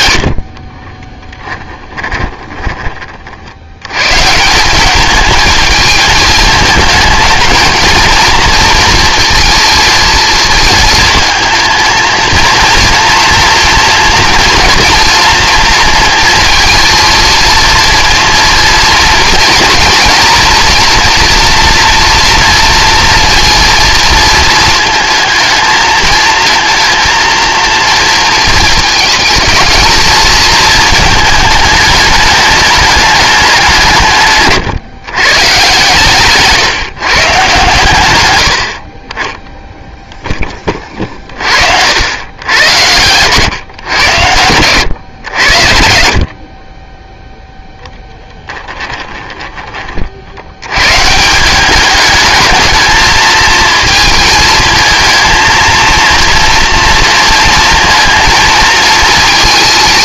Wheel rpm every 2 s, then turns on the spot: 30, 20, 200, 220, 230, 220, 230, 230, 230, 230, 230, 230, 230, 230, 220, 230, 210, 130, 150, 60, 20, 110, 100, 20, 20, 110, 220, 220, 230, 230.
0-2 42-44 48-50